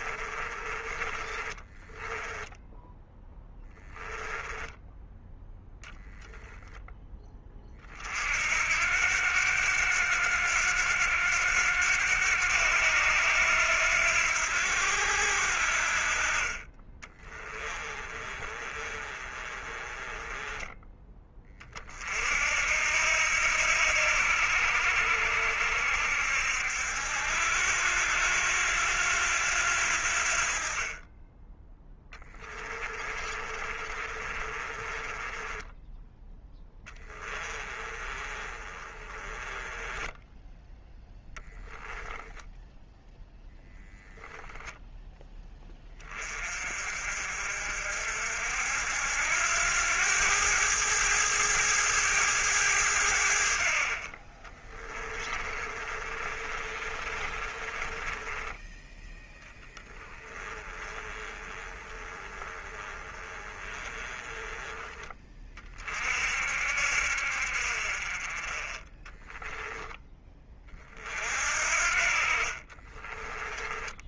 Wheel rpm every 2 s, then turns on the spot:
30, 10, 10, 0, 70, 90, 90, 80, 30, 30, 10, 60, 70, 70, 90, 40, 20, 20, 20, 20, 10, 0, 10, 40, 70, 100, 100, 30, 30, 10, 20, 20, 20, 60, 30, 30, 30.
0-4 16-20 32-40 54-58 60-64 68-70 72-74